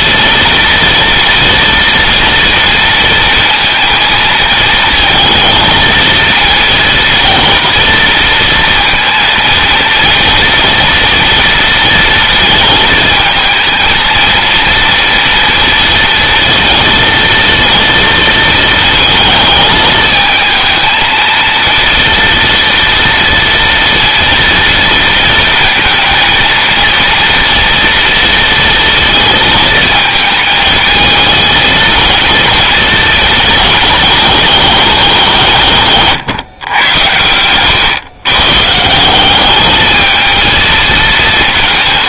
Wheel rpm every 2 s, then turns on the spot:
230, 230, 230, 230, 230, 240, 220, 230, 230, 230, 230, 230, 230, 230, 230, 220, 230, 200, 100, 170, 220.
none